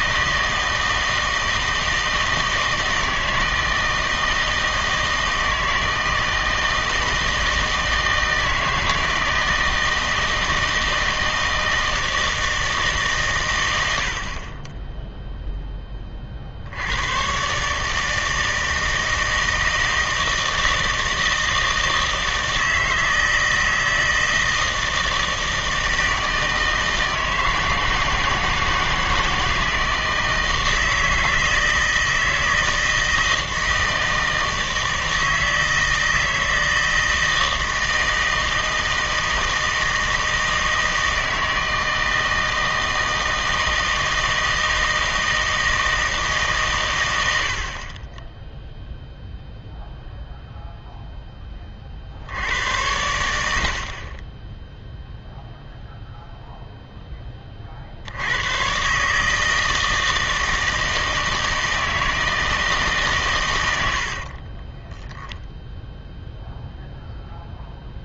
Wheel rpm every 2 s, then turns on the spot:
160, 160, 160, 160, 160, 160, 160, 20, 70, 160, 160, 160, 160, 160, 160, 160, 160, 160, 160, 160, 160, 160, 160, 130, 0, 0, 90, 10, 0, 120, 160, 160, 30, 0.
64-66